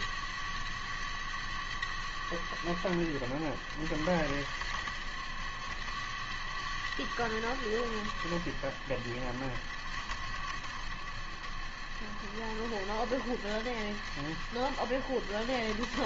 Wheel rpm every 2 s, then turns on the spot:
100, 90, 80, 100, 80, 70, 70, 80.
none